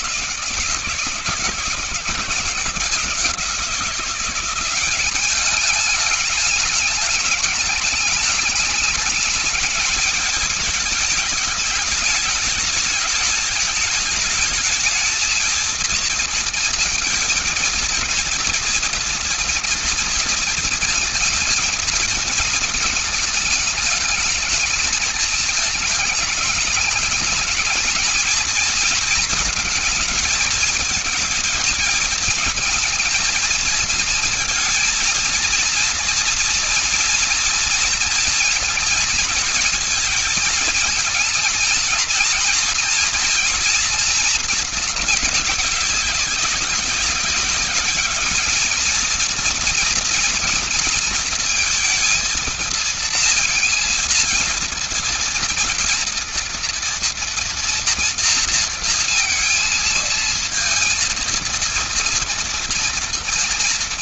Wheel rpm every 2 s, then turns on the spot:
180, 180, 190, 210, 210, 210, 210, 220, 220, 230, 220, 220, 220, 220, 220, 220, 230, 230, 240, 230, 220, 240, 230, 190, 220, 240, 230, 230, 230, 230, 230, 240.
none